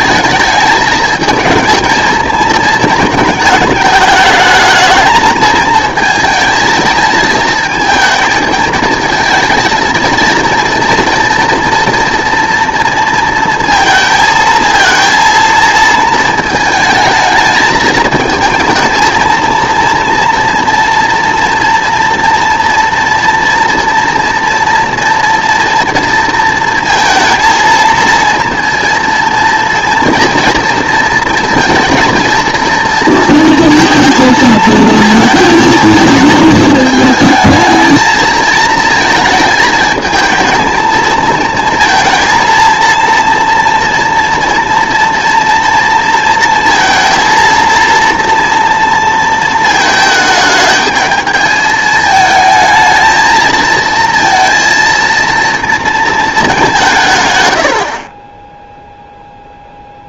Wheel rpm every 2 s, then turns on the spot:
210, 220, 220, 220, 220, 230, 230, 220, 220, 220, 230, 230, 240, 230, 230, 230, 230, 230, 220, 220, 220, 230, 230, 230, 230, 220, 220, 230, 180, 0.
none